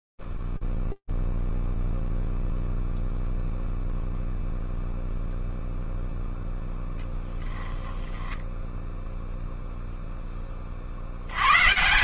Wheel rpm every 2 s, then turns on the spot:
0, 0, 0, 0, 10, 30.
none